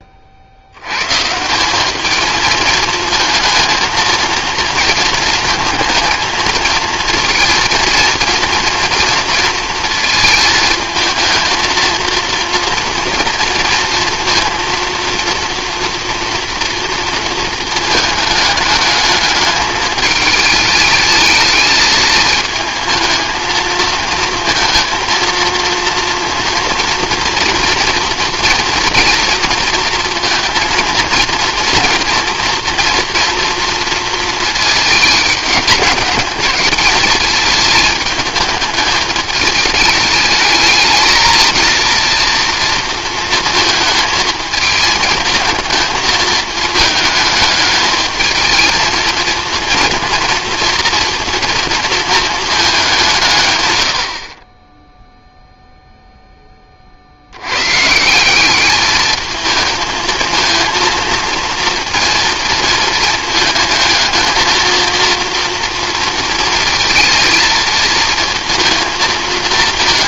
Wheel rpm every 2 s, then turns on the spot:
80, 220, 230, 230, 230, 220, 230, 230, 230, 210, 210, 220, 230, 240, 230, 230, 240, 220, 210, 210, 220, 230, 220, 220, 230, 230, 200, 10, 30, 210, 230, 220, 230, 230, 230.
none